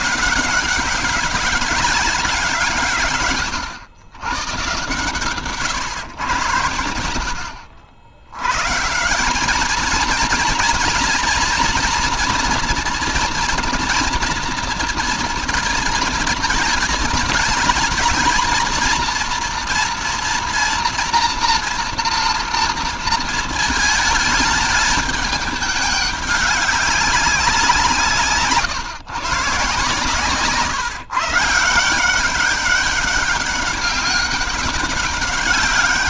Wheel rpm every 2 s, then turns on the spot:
190, 160, 130, 100, 120, 230, 240, 230, 220, 230, 230, 230, 210, 200, 140, 150, 200, 190.
none